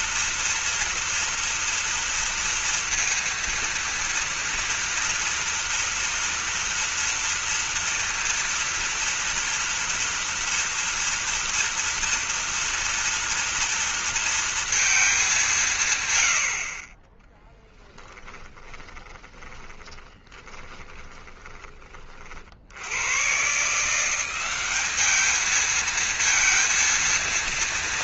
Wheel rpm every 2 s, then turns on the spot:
230, 230, 230, 230, 230, 230, 230, 230, 50, 20, 20, 70, 200, 230.
18-22